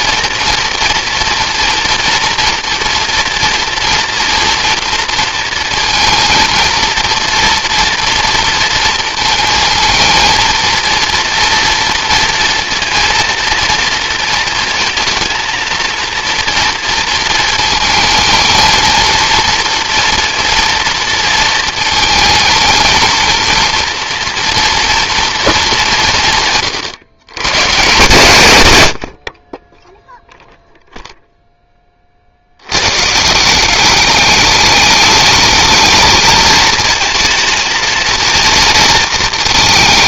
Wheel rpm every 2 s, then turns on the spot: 230, 230, 230, 230, 230, 230, 230, 230, 230, 230, 230, 220, 230, 130, 110, 0, 110, 210, 230, 230.
none